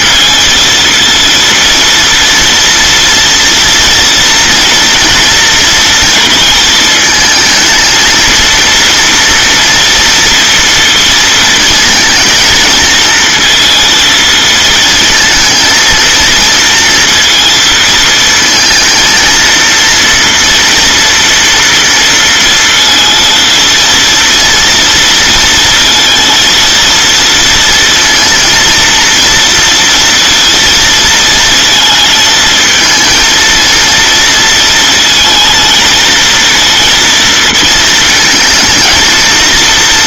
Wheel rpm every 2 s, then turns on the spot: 230, 230, 230, 220, 230, 230, 230, 230, 230, 230, 230, 230, 230, 230, 230, 230, 220, 230, 230, 230.
none